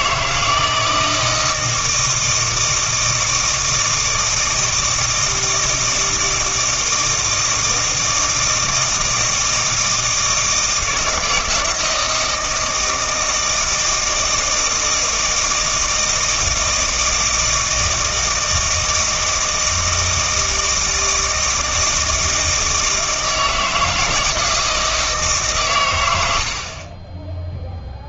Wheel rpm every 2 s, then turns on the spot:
160, 160, 160, 160, 160, 160, 160, 160, 160, 160, 160, 160, 160, 30.
none